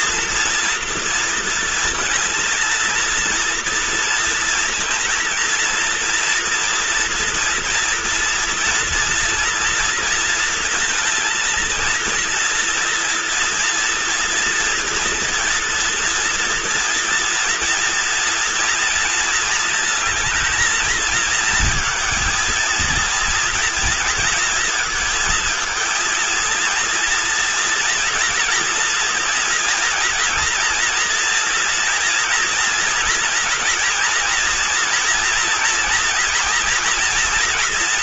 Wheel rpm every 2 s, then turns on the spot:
230, 230, 230, 230, 230, 230, 230, 240, 230, 230, 220, 230, 230, 230, 230, 230, 230, 240, 230.
none